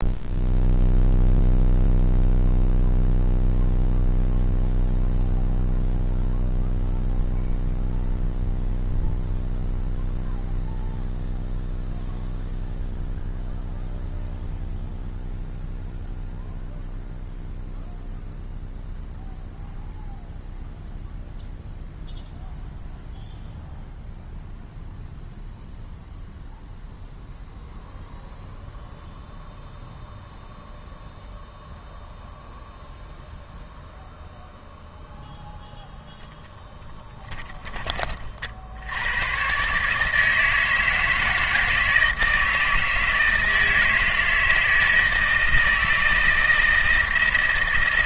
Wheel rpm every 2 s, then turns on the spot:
0, 0, 0, 0, 0, 0, 0, 0, 0, 0, 0, 0, 0, 0, 0, 0, 0, 0, 20, 90, 160, 160, 160, 160.
36-38